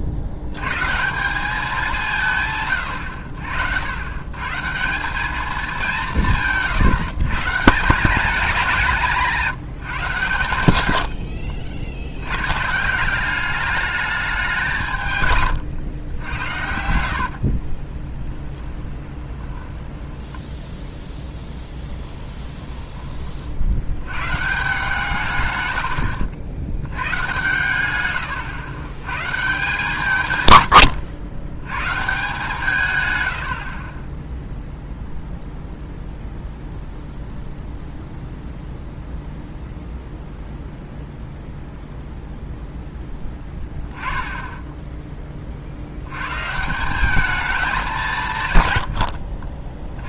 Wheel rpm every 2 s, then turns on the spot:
130, 120, 160, 160, 180, 100, 150, 170, 80, 10, 10, 20, 150, 90, 110, 110, 160, 0, 0, 0, 0, 0, 10, 170, 130.
16-20 22-24